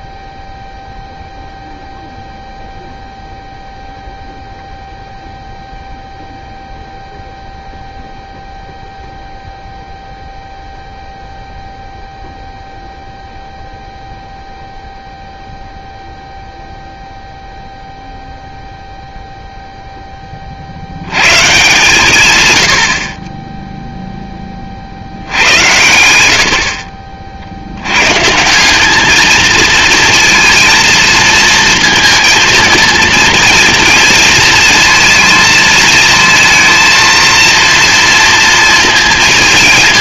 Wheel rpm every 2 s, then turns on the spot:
0, 0, 0, 0, 0, 0, 0, 0, 0, 0, 70, 80, 40, 60, 190, 230, 220, 230, 230, 230.
none